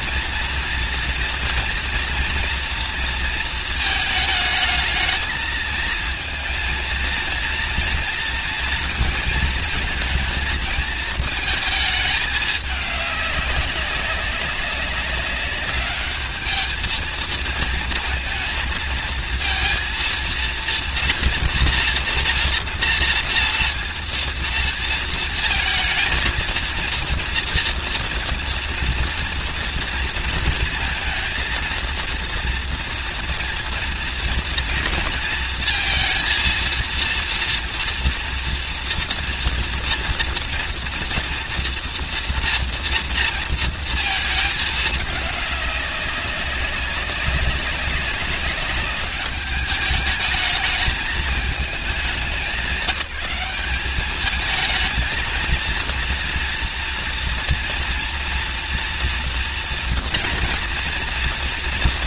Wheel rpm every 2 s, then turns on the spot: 230, 230, 220, 230, 230, 230, 200, 190, 220, 230, 230, 230, 230, 230, 230, 220, 240, 230, 230, 240, 230, 230, 210, 190, 200, 210, 180, 220, 230, 230, 230.
none